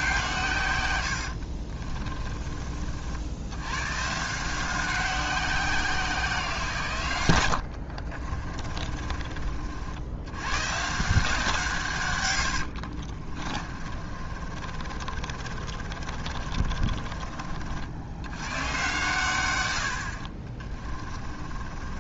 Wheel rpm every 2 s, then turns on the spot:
100, 50, 180, 130, 40, 140, 60, 40, 30, 110, 30.
8-10 12-18 20-22